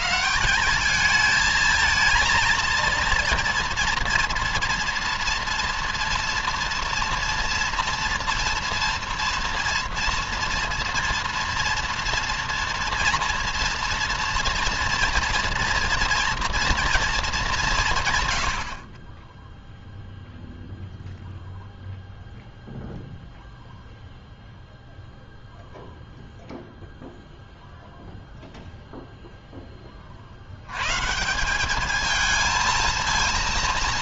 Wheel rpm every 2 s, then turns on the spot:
210, 230, 230, 230, 230, 230, 240, 230, 230, 30, 0, 0, 0, 0, 0, 130, 230.
none